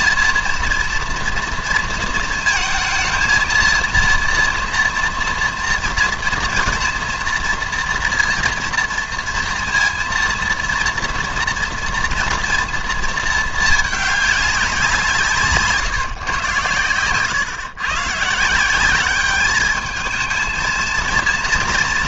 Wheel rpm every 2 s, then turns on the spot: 230, 230, 230, 240, 230, 230, 230, 190, 120, 170, 220.
none